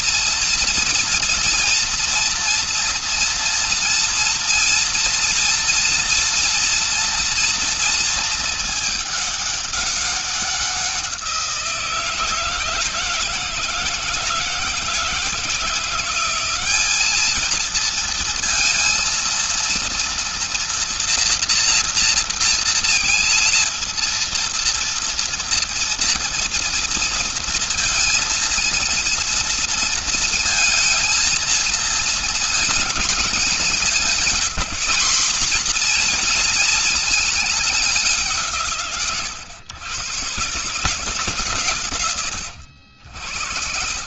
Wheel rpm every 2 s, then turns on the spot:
230, 230, 240, 230, 220, 180, 160, 160, 200, 230, 230, 230, 230, 230, 230, 230, 220, 210, 230, 140, 140, 80.
none